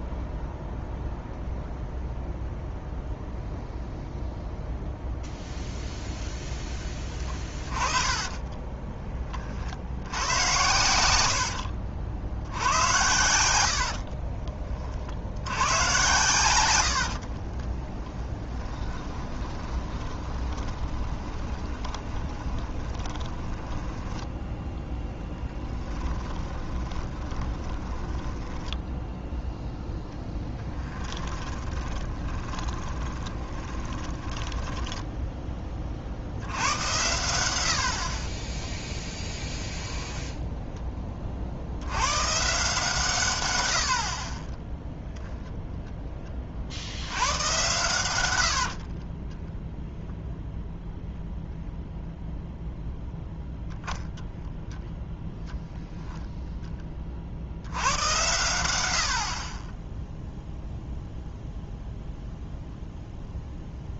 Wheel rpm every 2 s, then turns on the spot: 0, 0, 0, 10, 20, 100, 90, 40, 90, 20, 20, 20, 10, 20, 10, 10, 10, 20, 80, 10, 10, 150, 10, 50, 70, 0, 10, 10, 20, 100, 0, 0.
8-10 18-36 38-40 44-46 48-50